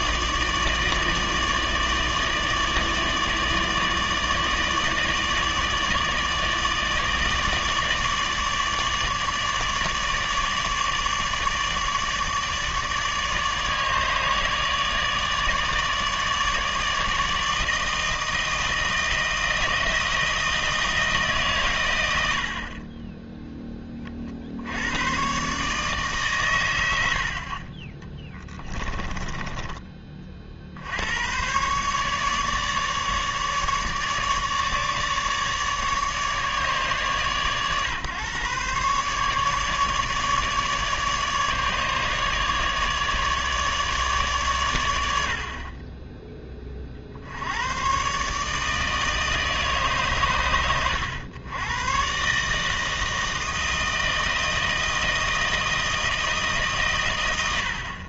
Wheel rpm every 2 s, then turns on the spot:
160, 150, 150, 160, 150, 150, 150, 150, 150, 160, 160, 30, 90, 100, 20, 70, 150, 150, 140, 130, 150, 150, 100, 30, 150, 110, 160, 160, 140.
28-30